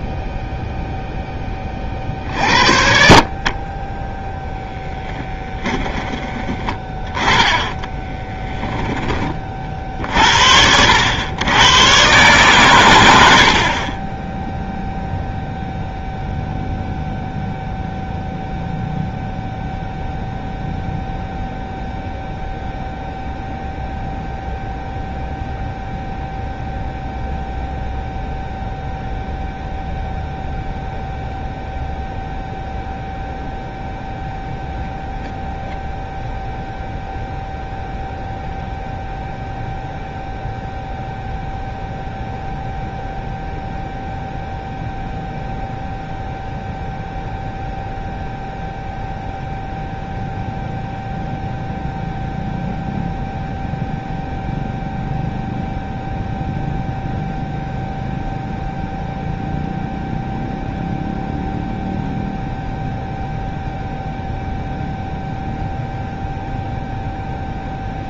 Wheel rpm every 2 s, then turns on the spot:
0, 60, 10, 20, 10, 80, 130, 0, 0, 0, 0, 0, 0, 0, 0, 0, 0, 0, 0, 0, 0, 0, 0, 0, 0, 0, 0, 0, 0, 0, 0, 0, 0, 0.
8-10